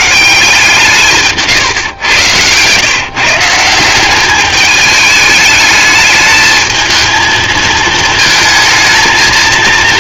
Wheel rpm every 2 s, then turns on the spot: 170, 120, 210, 220, 220.
none